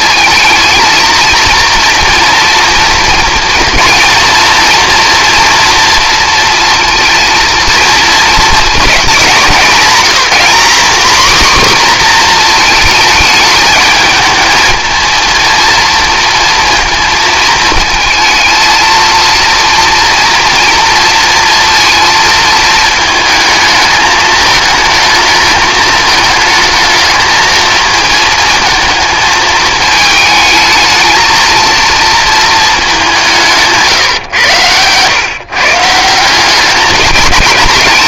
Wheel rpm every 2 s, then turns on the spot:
220, 240, 230, 230, 220, 210, 240, 230, 230, 220, 240, 230, 220, 220, 220, 220, 220, 120, 180.
none